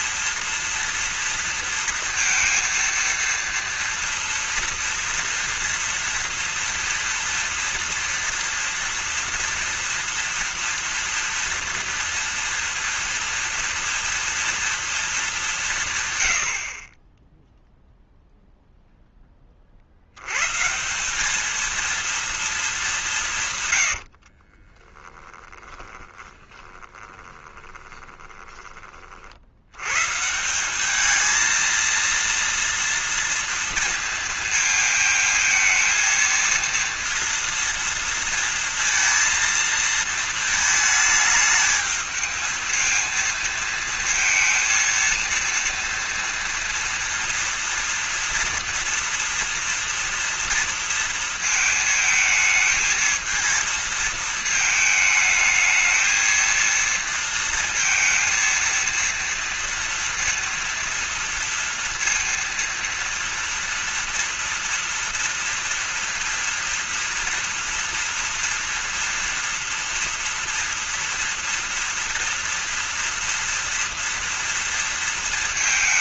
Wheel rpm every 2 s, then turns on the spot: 230, 230, 230, 230, 230, 230, 230, 230, 60, 0, 150, 220, 30, 20, 20, 170, 230, 220, 230, 230, 220, 220, 230, 230, 230, 230, 220, 220, 230, 230, 230, 230, 230, 230, 230, 230, 230, 230.
24-30